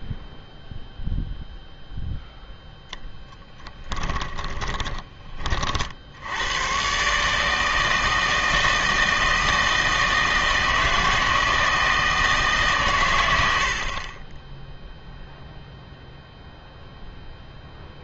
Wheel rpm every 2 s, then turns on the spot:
0, 0, 20, 110, 160, 160, 150, 10, 0.
4-6